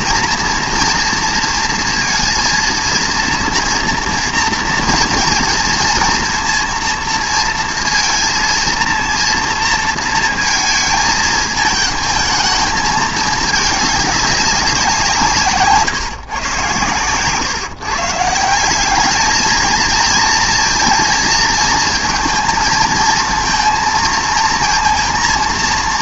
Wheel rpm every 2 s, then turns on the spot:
240, 230, 230, 230, 230, 220, 210, 180, 130, 190, 230, 220, 230.
none